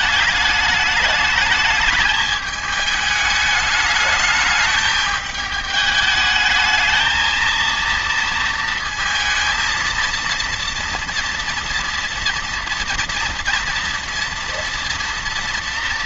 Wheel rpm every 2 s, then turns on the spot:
210, 210, 210, 220, 230, 230, 230, 230.
none